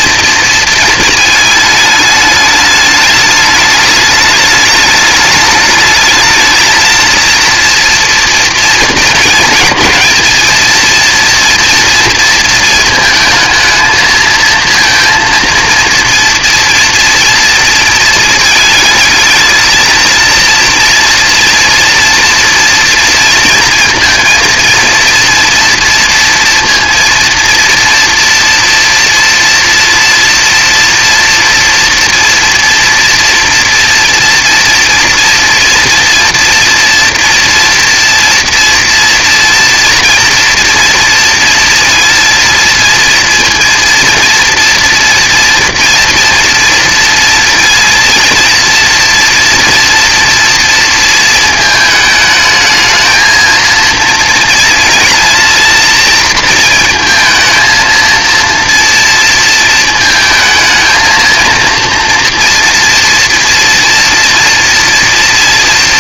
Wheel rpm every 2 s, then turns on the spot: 230, 210, 210, 220, 240, 230, 220, 230, 230, 220, 230, 230, 230, 230, 230, 240, 230, 230, 230, 230, 230, 230, 230, 230, 230, 230, 220, 230, 230, 230, 220, 230, 230.
none